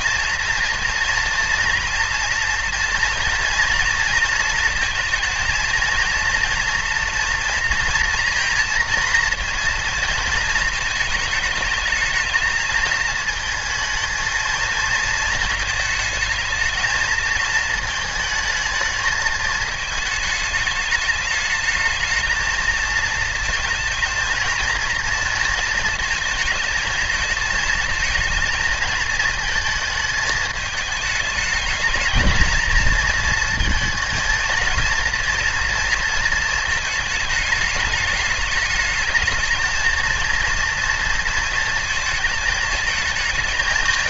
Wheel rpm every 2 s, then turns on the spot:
230, 230, 230, 230, 230, 220, 220, 230, 220, 220, 210, 230, 230, 220, 230, 210, 220, 230, 220, 220, 230, 220.
none